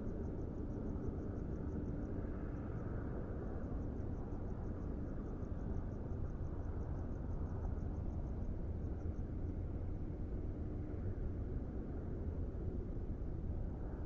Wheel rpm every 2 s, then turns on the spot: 0, 0, 0, 0, 0, 0, 0.
none